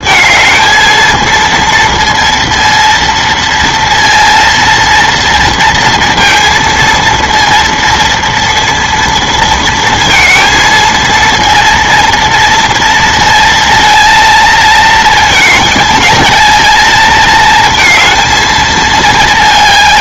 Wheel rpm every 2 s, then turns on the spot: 230, 230, 230, 230, 230, 230, 230, 220, 220, 220.
none